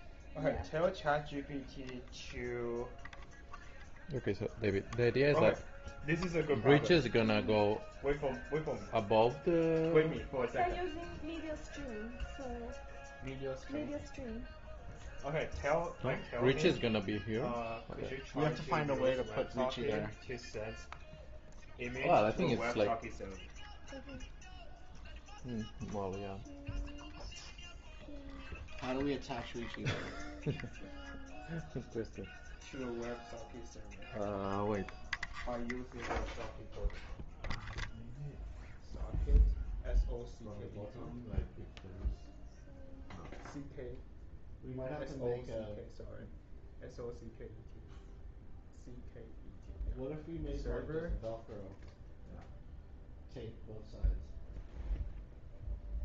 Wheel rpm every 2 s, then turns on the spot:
0, 0, 0, 0, 0, 0, 0, 0, 0, 0, 0, 0, 0, 0, 0, 0, 0, 0, 0, 0, 0, 0, 0, 0, 0, 0, 0, 0.
none